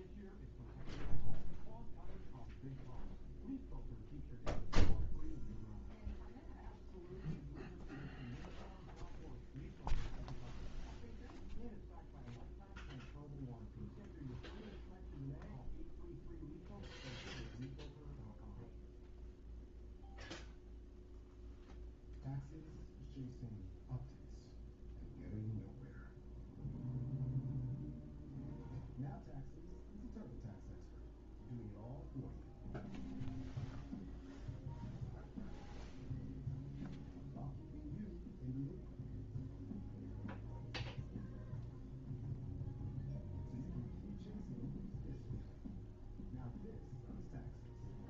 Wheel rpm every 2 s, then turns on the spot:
0, 0, 0, 0, 0, 0, 0, 0, 0, 0, 0, 0, 0, 0, 0, 0, 0, 0, 0, 0, 0, 0, 0, 0.
none